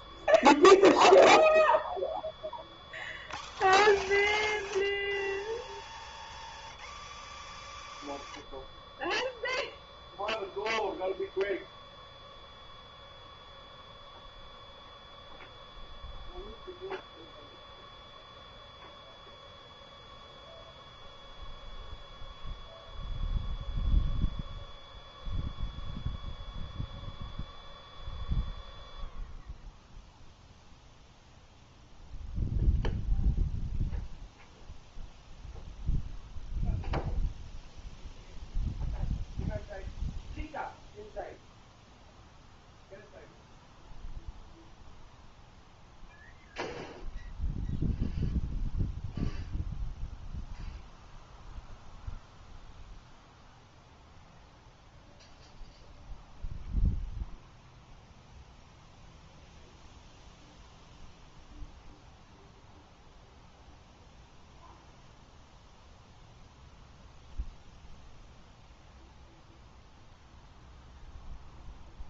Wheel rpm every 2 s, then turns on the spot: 0, 0, 0, 0, 0, 0, 0, 0, 0, 0, 0, 0, 0, 0, 0, 0, 0, 0, 0, 0, 0, 0, 0, 0, 0, 0, 0, 0, 0, 0, 0, 0, 0, 0, 0, 0.
none